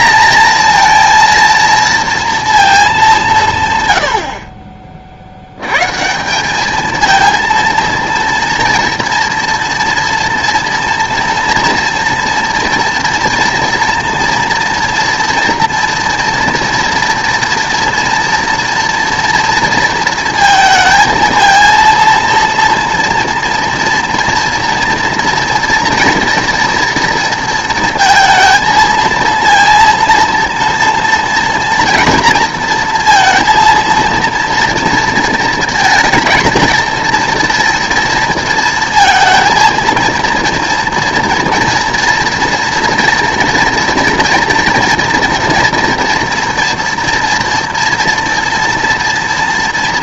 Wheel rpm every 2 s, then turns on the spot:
230, 230, 30, 200, 230, 230, 230, 230, 230, 230, 230, 230, 230, 230, 220, 230, 230, 230, 230, 220, 230, 230, 230, 230, 240.
none